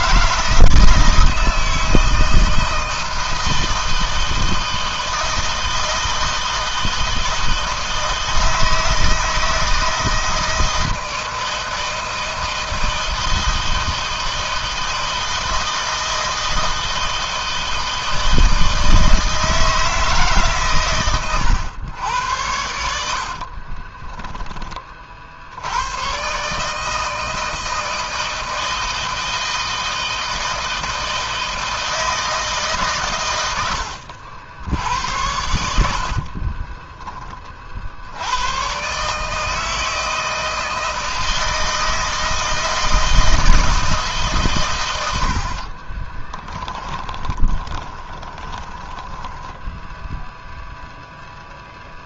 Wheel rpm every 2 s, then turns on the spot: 160, 160, 160, 160, 160, 160, 160, 160, 160, 160, 130, 80, 30, 150, 160, 160, 130, 80, 20, 130, 160, 160, 120, 10, 10, 0.
36-38 46-50